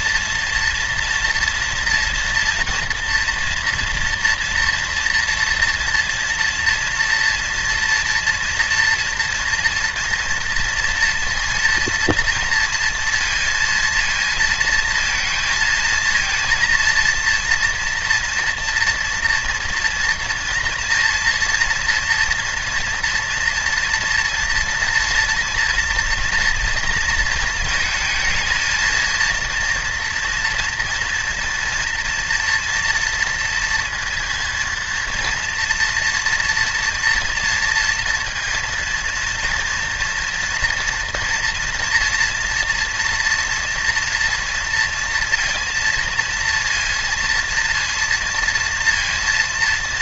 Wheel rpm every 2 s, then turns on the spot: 230, 230, 230, 240, 230, 230, 230, 230, 230, 240, 230, 240, 240, 230, 230, 230, 230, 230, 230, 230, 230, 230, 230, 230, 230.
none